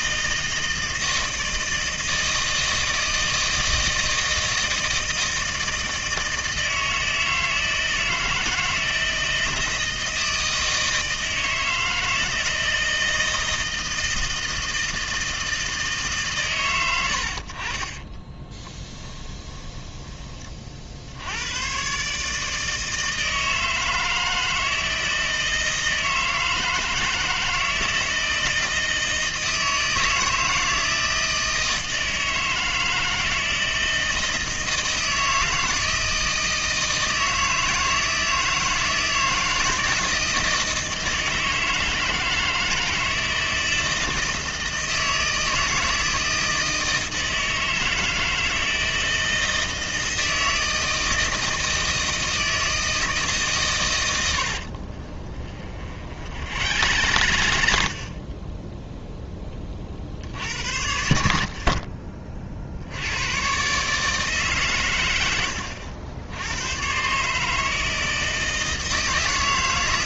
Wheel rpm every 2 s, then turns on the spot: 160, 160, 160, 160, 160, 160, 160, 160, 100, 20, 50, 160, 160, 160, 160, 160, 160, 160, 160, 160, 160, 160, 160, 160, 160, 160, 160, 60, 80, 10, 60, 60, 120, 100, 160.
18-20 54-58